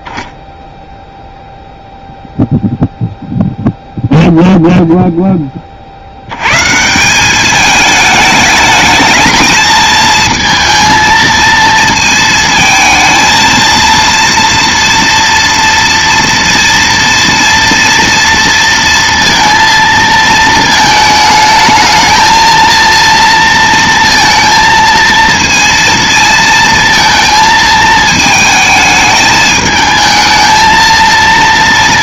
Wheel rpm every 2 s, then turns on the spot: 0, 0, 0, 140, 220, 230, 220, 230, 230, 230, 220, 230, 230, 230, 220, 220.
none